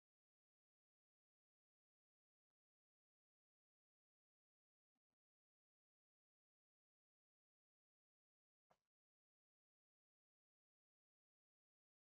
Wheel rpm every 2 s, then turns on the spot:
0, 0, 0, 0, 0, 0.
none